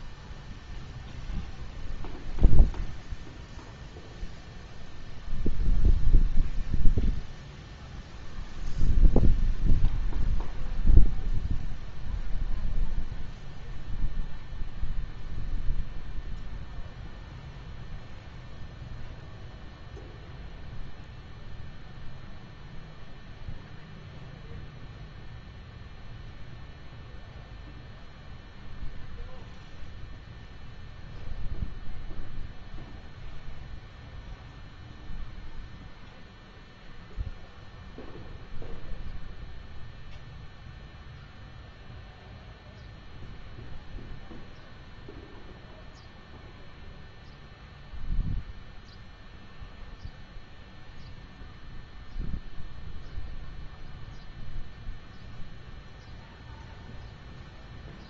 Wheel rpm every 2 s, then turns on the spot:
0, 0, 0, 0, 0, 0, 0, 0, 0, 0, 0, 0, 0, 0, 0, 0, 0, 0, 0, 0, 0, 0, 0, 0, 0, 0, 0, 0, 0.
none